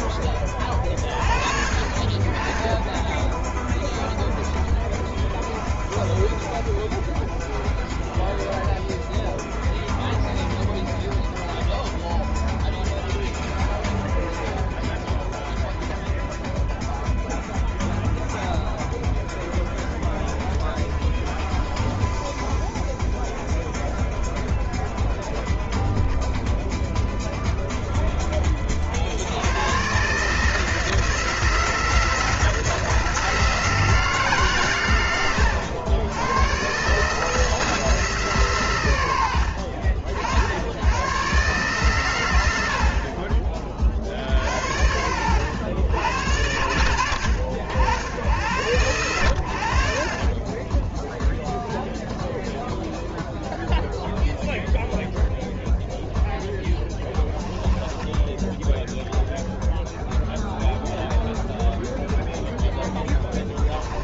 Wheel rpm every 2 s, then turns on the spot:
30, 10, 0, 0, 0, 0, 0, 0, 0, 0, 0, 0, 0, 0, 40, 160, 160, 120, 130, 110, 90, 60, 70, 80, 100, 20, 0, 0, 10, 0, 0, 10.
56-58